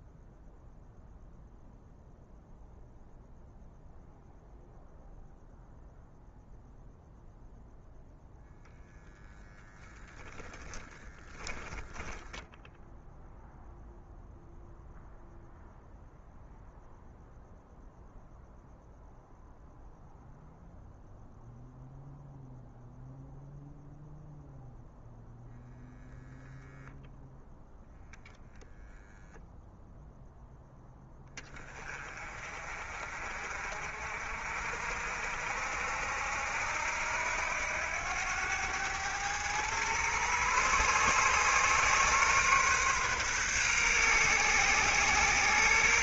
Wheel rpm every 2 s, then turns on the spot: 0, 0, 0, 0, 0, 10, 0, 0, 0, 0, 0, 0, 0, 0, 0, 10, 40, 60, 80, 100, 120, 130, 130.
none